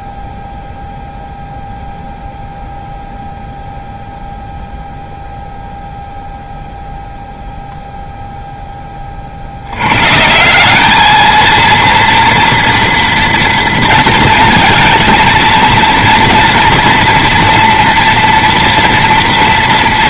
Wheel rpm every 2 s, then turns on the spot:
0, 0, 0, 0, 30, 210, 230, 230, 230, 240.
none